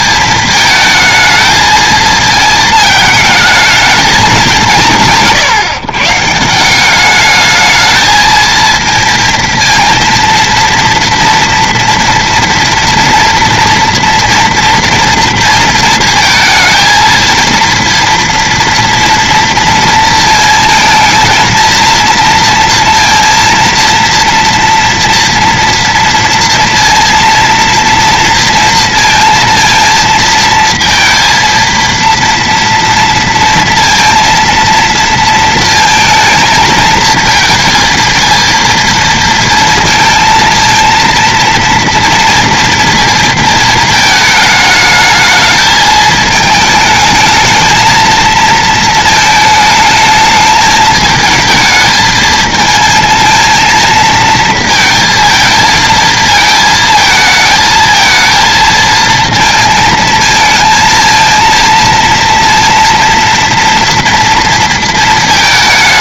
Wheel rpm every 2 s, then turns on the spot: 220, 230, 200, 160, 220, 230, 230, 230, 220, 230, 230, 230, 230, 230, 230, 230, 230, 230, 220, 230, 230, 230, 220, 220, 230, 220, 220, 230, 220, 220, 230, 230, 230.
none